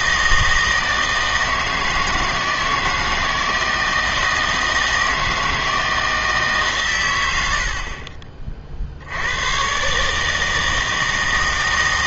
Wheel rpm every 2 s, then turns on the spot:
160, 160, 160, 140, 50, 160.
none